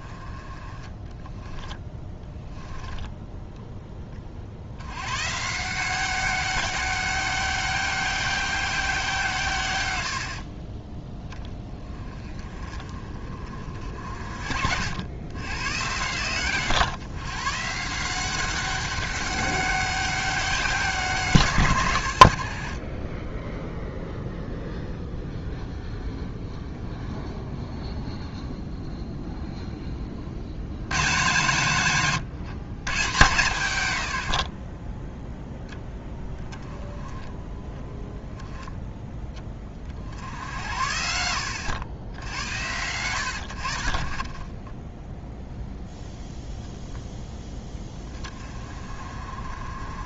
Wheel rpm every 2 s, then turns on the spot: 20, 10, 90, 200, 190, 40, 30, 80, 130, 200, 180, 40, 0, 0, 0, 110, 140, 30, 20, 10, 80, 100, 10, 0, 30.
2-4